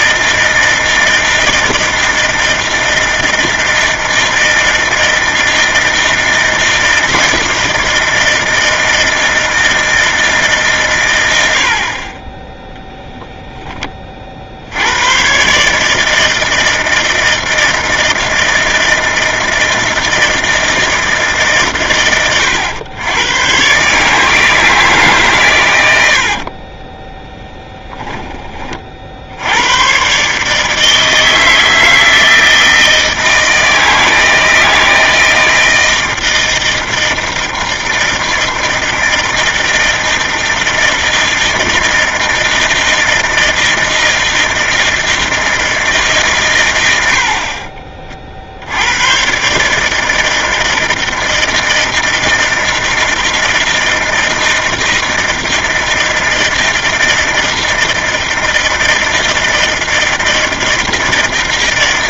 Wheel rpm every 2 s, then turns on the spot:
160, 160, 160, 160, 160, 150, 10, 40, 160, 160, 160, 90, 150, 60, 10, 130, 160, 160, 160, 160, 160, 160, 160, 150, 40, 160, 160, 160, 160, 160, 160.
26-28